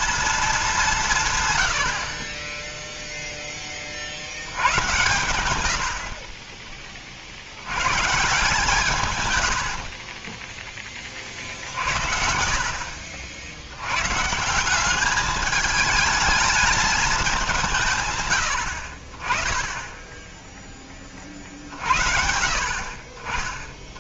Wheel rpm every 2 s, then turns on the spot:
200, 20, 90, 40, 150, 30, 70, 180, 220, 90, 10, 50.
10-12